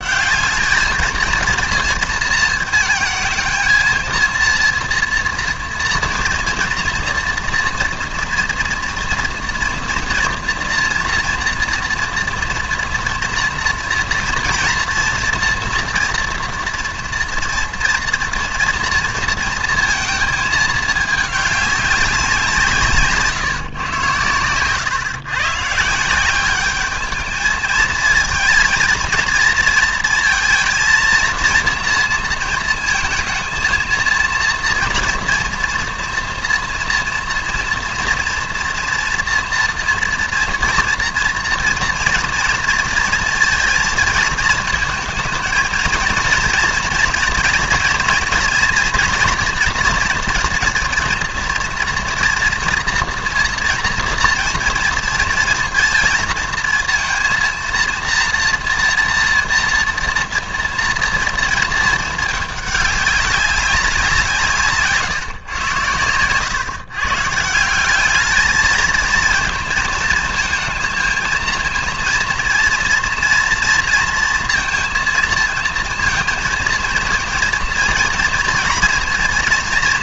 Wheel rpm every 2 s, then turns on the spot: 200, 220, 230, 230, 230, 240, 230, 240, 230, 230, 210, 160, 120, 200, 230, 230, 230, 230, 240, 230, 230, 240, 230, 230, 230, 230, 230, 230, 230, 230, 230, 210, 160, 120, 220, 230, 230, 230, 230, 240.
none